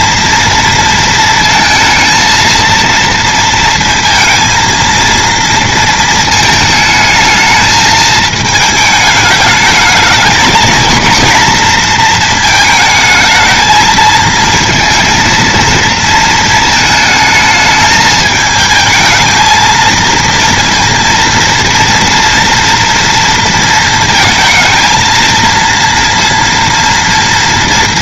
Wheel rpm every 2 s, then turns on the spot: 230, 230, 230, 220, 220, 230, 220, 220, 220, 220, 230, 230, 230, 240.
none